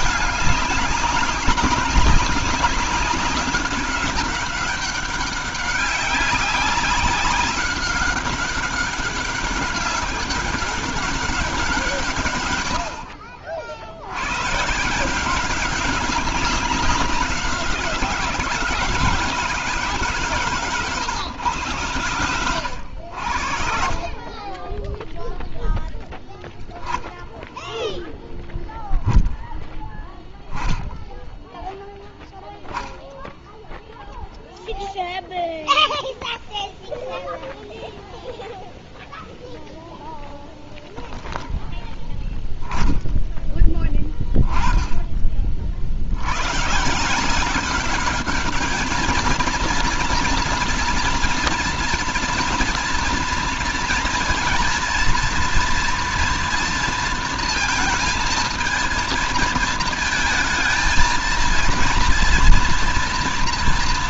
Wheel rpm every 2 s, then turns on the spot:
200, 190, 200, 200, 200, 200, 100, 130, 190, 160, 130, 90, 20, 0, 0, 0, 0, 0, 0, 0, 10, 10, 30, 110, 210, 230, 230, 230, 230, 220, 220, 240.
20-22